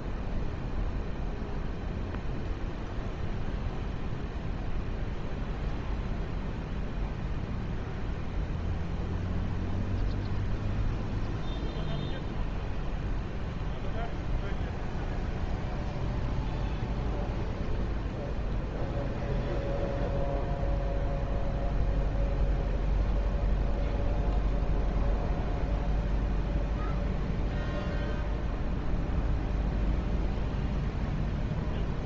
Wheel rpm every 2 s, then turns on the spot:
0, 0, 0, 0, 0, 0, 0, 0, 0, 0, 0, 0, 0, 0, 0, 0.
none